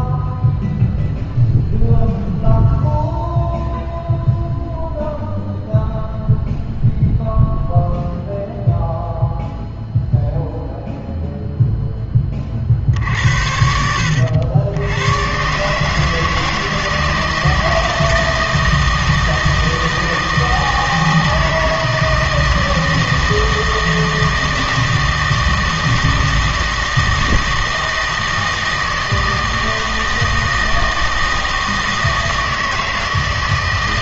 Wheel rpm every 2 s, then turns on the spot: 0, 0, 0, 0, 0, 0, 40, 90, 160, 160, 160, 160, 160, 160, 160, 160, 160.
none